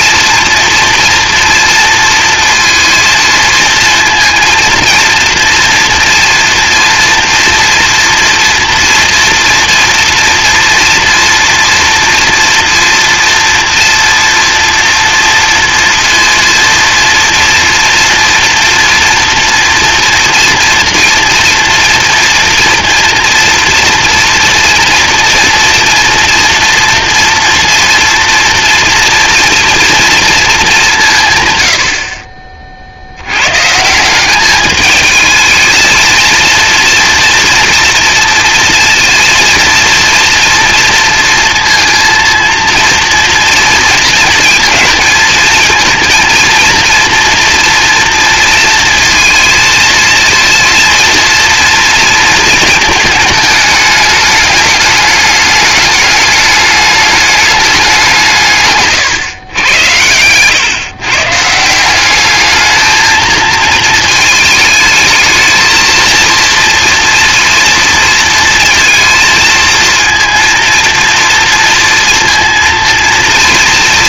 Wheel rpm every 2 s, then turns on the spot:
230, 230, 230, 230, 230, 240, 230, 230, 230, 230, 230, 240, 240, 230, 240, 220, 50, 200, 230, 230, 240, 230, 220, 230, 230, 230, 230, 210, 210, 150, 120, 210, 220, 230, 230, 230, 230.
none